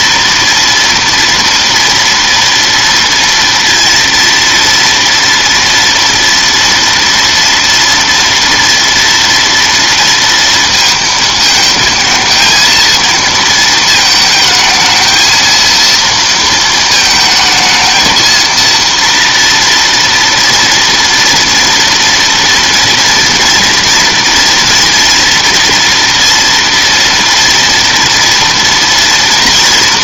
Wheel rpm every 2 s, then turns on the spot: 230, 230, 230, 230, 230, 230, 230, 220, 220, 230, 230, 240, 230, 230, 230.
none